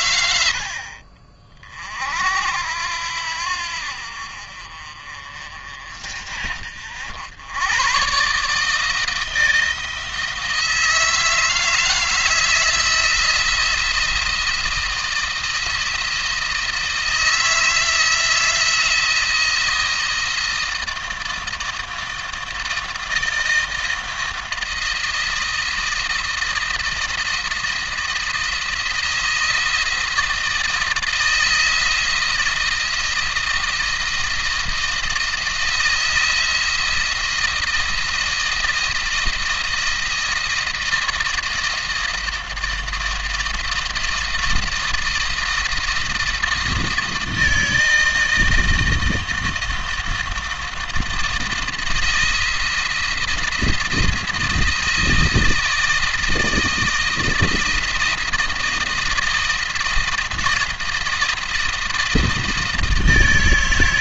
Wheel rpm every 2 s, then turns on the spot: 70, 70, 50, 60, 150, 160, 160, 170, 160, 170, 160, 160, 170, 160, 160, 160, 170, 160, 170, 170, 160, 170, 160, 160, 160, 160, 170, 170, 160, 160, 170, 160.
none